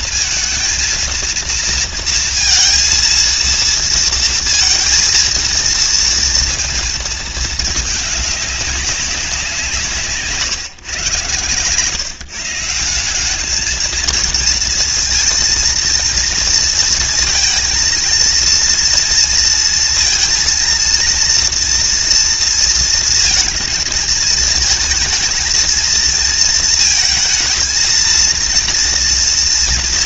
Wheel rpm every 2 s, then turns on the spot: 230, 230, 230, 220, 190, 120, 190, 230, 230, 230, 230, 230, 230, 230, 240.
none